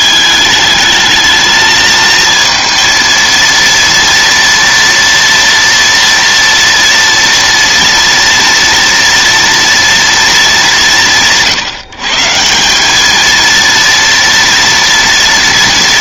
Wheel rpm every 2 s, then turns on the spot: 220, 230, 240, 230, 230, 120, 220, 230.
none